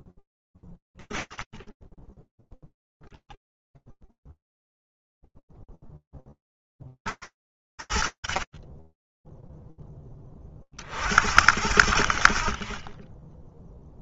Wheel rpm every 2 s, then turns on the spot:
10, 0, 0, 50, 30, 50, 30.
none